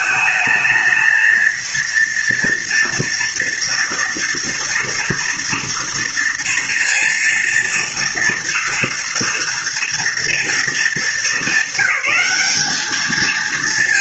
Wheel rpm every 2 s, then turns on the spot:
220, 230, 240, 230, 230, 220, 210.
none